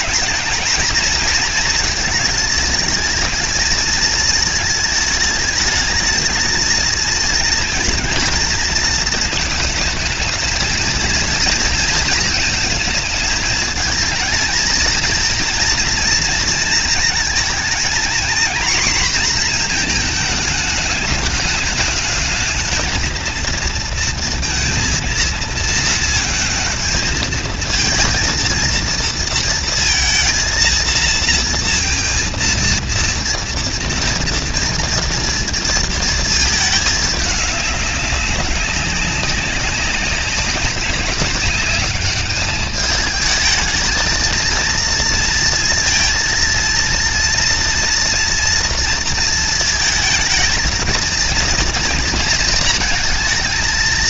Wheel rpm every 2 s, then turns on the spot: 230, 220, 220, 230, 220, 230, 230, 230, 230, 240, 220, 230, 230, 220, 230, 230, 230, 230, 210, 190, 200, 210, 230, 230, 230, 220, 220.
none